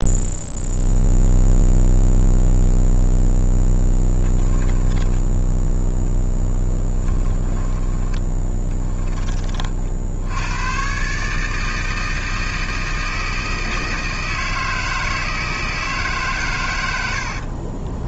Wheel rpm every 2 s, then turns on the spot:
0, 0, 10, 10, 10, 110, 160, 160, 110.
4-8